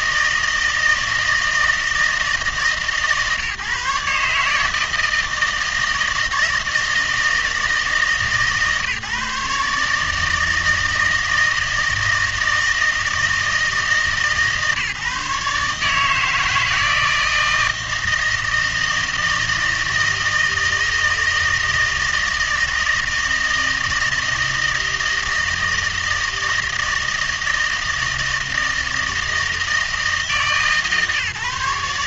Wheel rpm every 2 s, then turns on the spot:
160, 150, 150, 160, 150, 160, 160, 140, 160, 160, 160, 160, 160, 160, 160, 150.
none